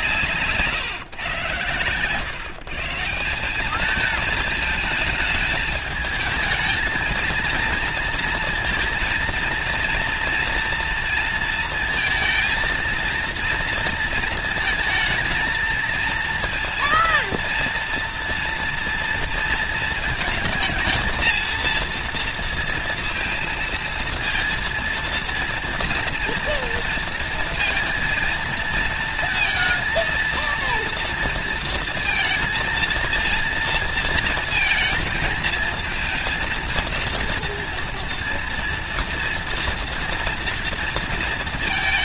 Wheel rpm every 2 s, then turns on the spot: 150, 150, 220, 220, 230, 230, 230, 230, 230, 230, 220, 230, 230, 230, 230, 230, 220, 230, 230, 230, 230.
0-2